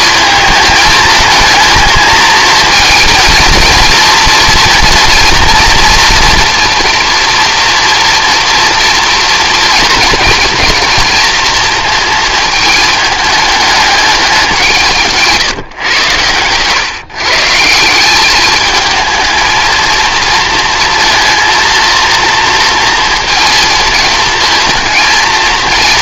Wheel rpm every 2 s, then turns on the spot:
220, 230, 240, 230, 230, 240, 220, 170, 140, 220, 230, 230, 230.
none